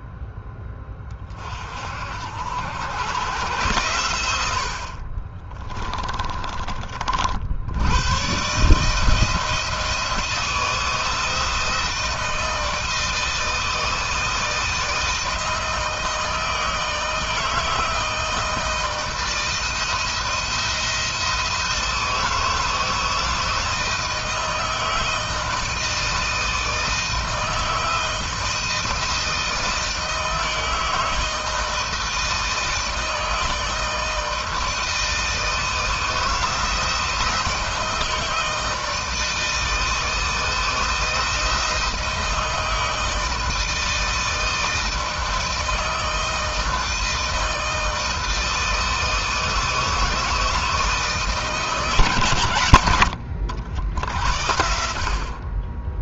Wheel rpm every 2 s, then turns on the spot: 20, 100, 50, 40, 150, 160, 160, 160, 160, 160, 170, 160, 160, 160, 160, 160, 160, 160, 160, 160, 160, 160, 160, 160, 160, 160, 100, 70.
4-6 52-54